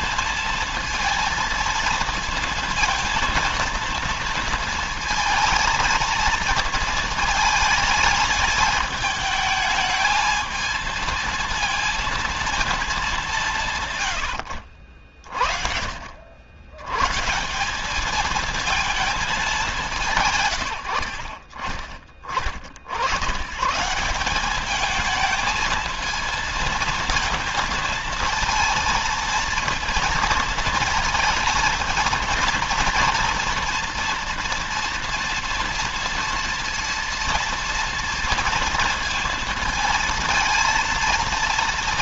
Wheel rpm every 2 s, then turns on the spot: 220, 230, 230, 230, 220, 220, 220, 80, 90, 220, 140, 30, 200, 230, 230, 230, 230, 230, 230, 230, 230.
none